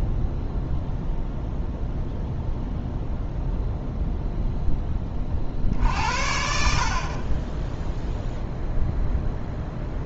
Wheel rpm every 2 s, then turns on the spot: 0, 0, 10, 50, 0.
6-8